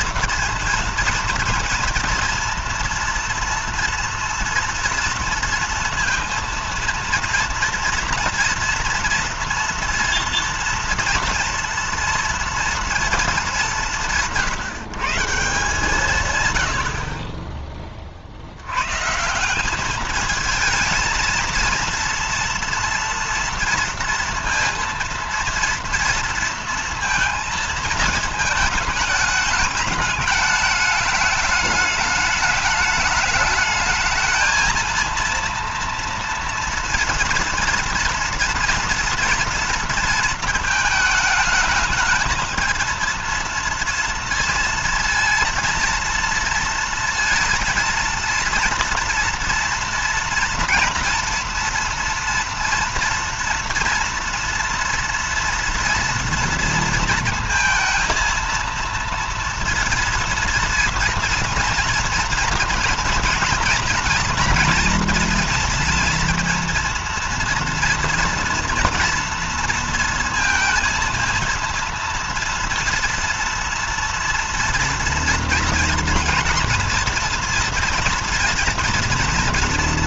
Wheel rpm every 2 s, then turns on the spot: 230, 230, 230, 230, 240, 230, 230, 160, 130, 70, 220, 230, 230, 230, 220, 210, 210, 220, 230, 230, 220, 220, 230, 230, 230, 230, 230, 230, 230, 230, 230, 230, 240, 230, 240, 230, 230, 230, 240, 230.
none